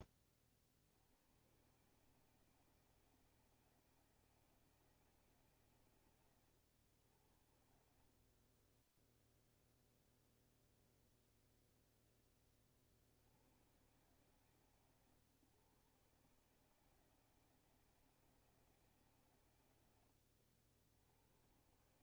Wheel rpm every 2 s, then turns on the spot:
40, 160, 160, 110, 30, 0, 20, 140, 150, 160, 80.
8-10